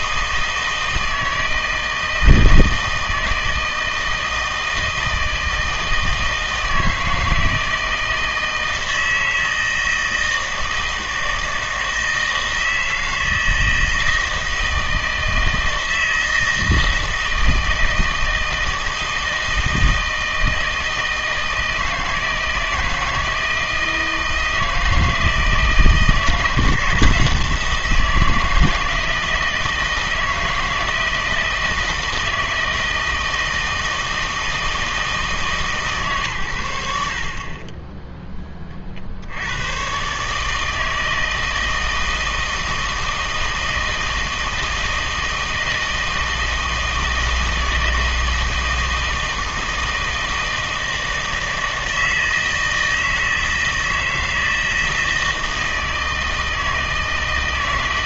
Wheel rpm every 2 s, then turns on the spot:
160, 160, 160, 160, 160, 160, 160, 160, 160, 160, 160, 160, 160, 170, 160, 160, 160, 160, 80, 30, 160, 160, 160, 160, 160, 160, 160, 160, 160.
none